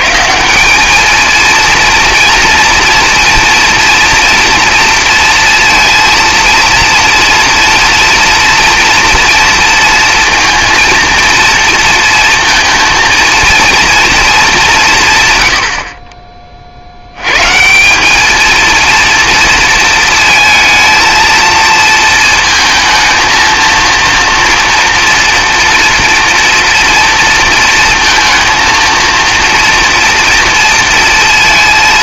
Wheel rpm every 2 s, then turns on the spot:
190, 230, 230, 230, 230, 230, 230, 180, 50, 230, 230, 230, 230, 230, 230, 230.
none